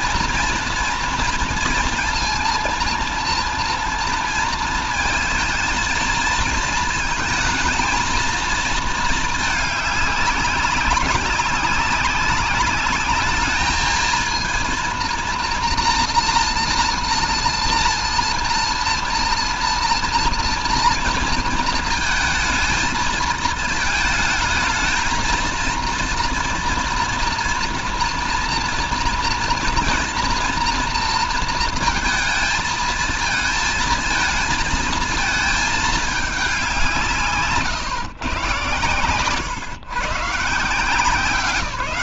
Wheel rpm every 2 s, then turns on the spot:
230, 230, 230, 230, 220, 190, 200, 230, 230, 230, 230, 220, 220, 230, 230, 230, 230, 230, 180, 110, 150.
none